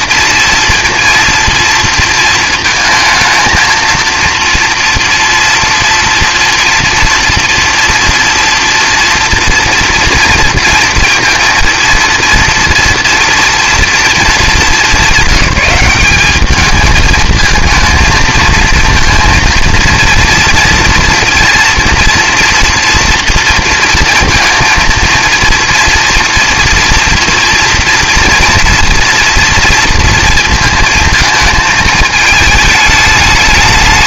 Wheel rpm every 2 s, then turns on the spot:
230, 230, 230, 230, 230, 230, 230, 200, 220, 230, 230, 230, 230, 240, 230, 230, 220.
none